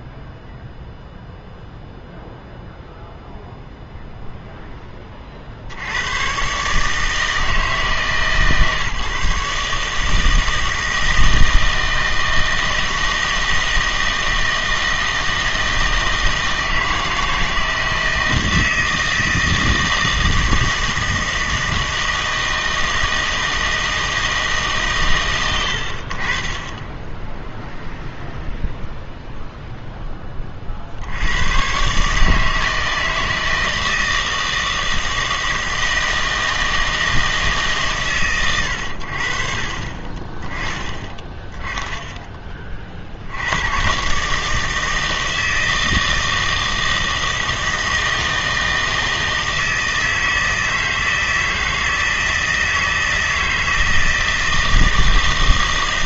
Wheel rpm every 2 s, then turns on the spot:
0, 0, 10, 150, 150, 160, 160, 160, 160, 160, 160, 160, 140, 10, 0, 60, 160, 160, 160, 90, 10, 30, 160, 160, 160, 160, 160, 160.
none